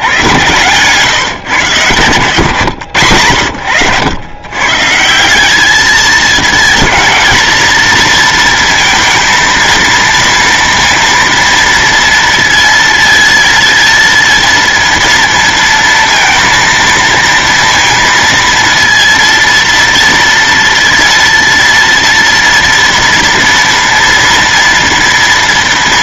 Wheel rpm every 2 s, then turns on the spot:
120, 120, 120, 220, 230, 230, 230, 230, 230, 230, 230, 230, 230.
none